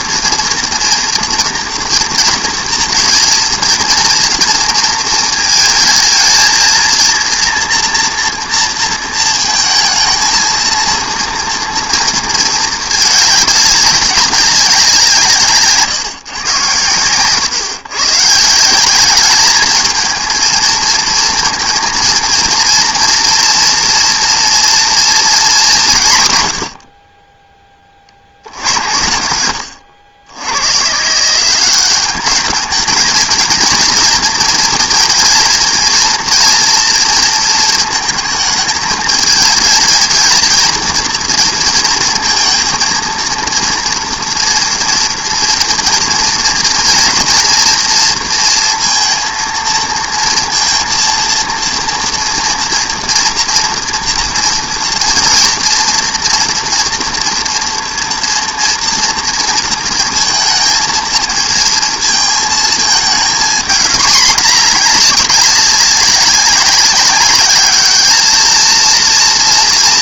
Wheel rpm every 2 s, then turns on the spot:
230, 230, 230, 220, 230, 230, 220, 190, 120, 170, 220, 230, 230, 100, 80, 110, 210, 230, 230, 220, 230, 230, 240, 240, 230, 230, 230, 230, 230, 230, 220, 220, 220, 200, 230.
none